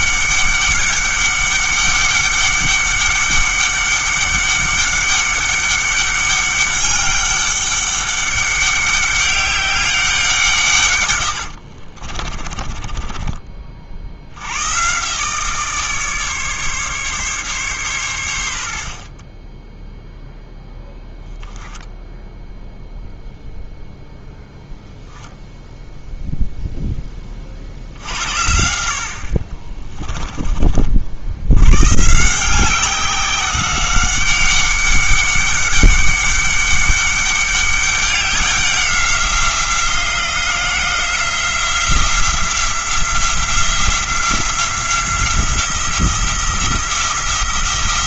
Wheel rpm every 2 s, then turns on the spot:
200, 200, 200, 200, 200, 140, 20, 110, 140, 80, 0, 0, 10, 0, 70, 40, 190, 200, 200, 190, 180, 170, 180, 170.
12-14